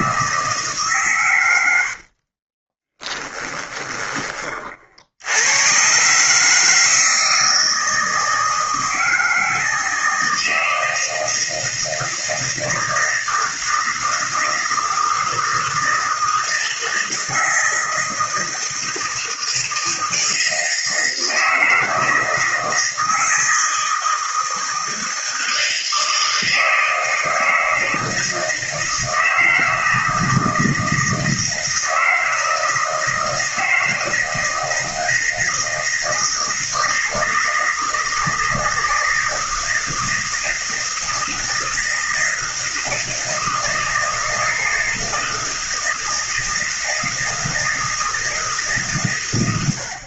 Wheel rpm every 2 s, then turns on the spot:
160, 30, 40, 150, 160, 160, 160, 160, 160, 160, 160, 160, 160, 160, 160, 170, 160, 160, 160, 160, 160, 160, 160, 160, 150.
2-4